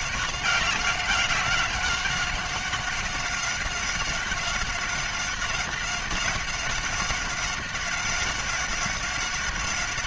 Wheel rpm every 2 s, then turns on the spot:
190, 190, 190, 190, 190.
none